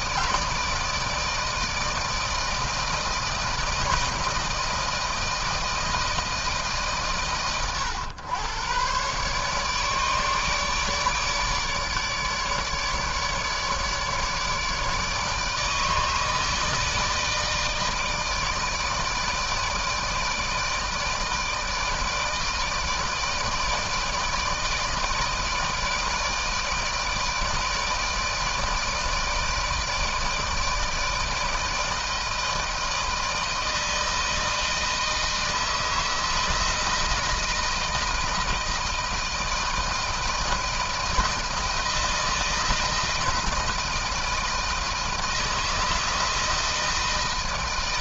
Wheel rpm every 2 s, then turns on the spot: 160, 160, 160, 150, 120, 150, 150, 150, 160, 160, 160, 160, 160, 160, 160, 160, 160, 160, 160, 160, 160, 160, 160, 160.
none